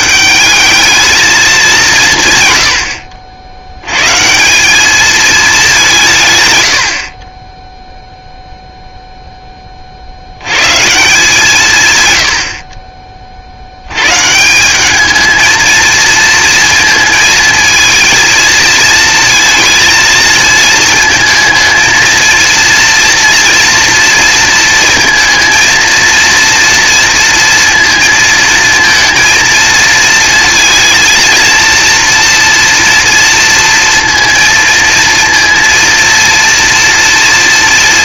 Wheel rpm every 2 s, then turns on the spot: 190, 90, 200, 100, 0, 140, 40, 180, 230, 220, 220, 240, 230, 230, 230, 230, 230, 230, 230.
none